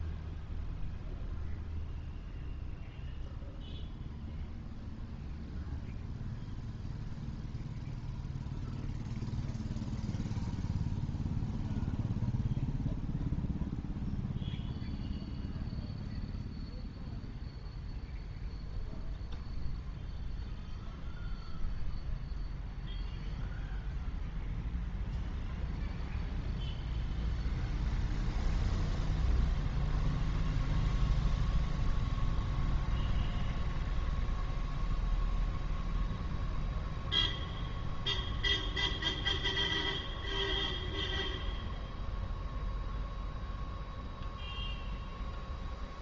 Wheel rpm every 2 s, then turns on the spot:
0, 0, 0, 0, 0, 0, 0, 0, 0, 0, 0, 0, 0, 0, 0, 0, 0, 0, 0, 0, 0, 0, 0.
none